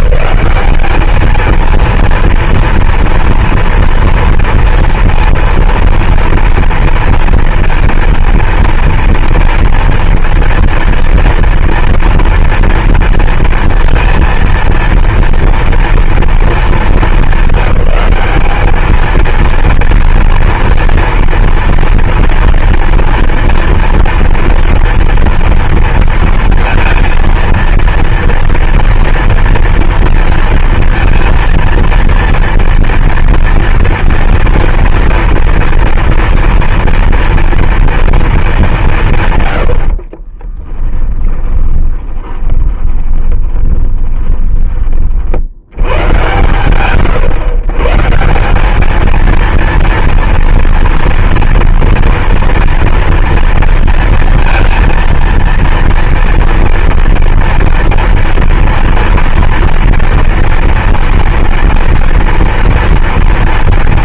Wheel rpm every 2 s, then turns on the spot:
210, 230, 230, 230, 230, 230, 230, 230, 220, 210, 230, 230, 230, 230, 230, 230, 230, 230, 240, 210, 30, 20, 20, 120, 180, 230, 230, 230, 230, 230, 230, 230.
40-46